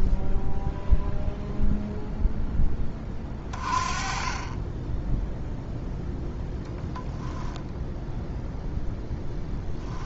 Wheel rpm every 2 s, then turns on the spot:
0, 30, 10, 0, 20.
8-10